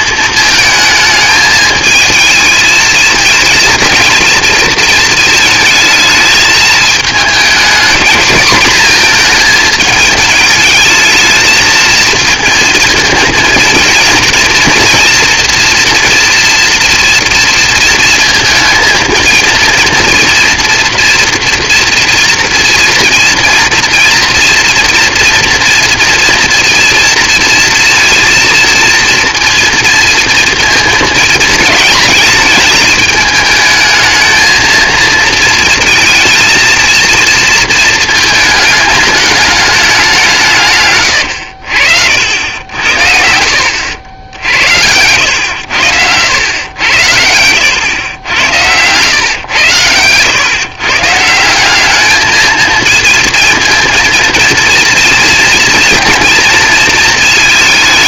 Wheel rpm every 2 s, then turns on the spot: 220, 220, 220, 220, 230, 220, 230, 240, 230, 230, 230, 230, 230, 230, 230, 220, 210, 230, 230, 210, 100, 70, 90, 90, 110, 150, 220, 230, 220.
40-42 46-48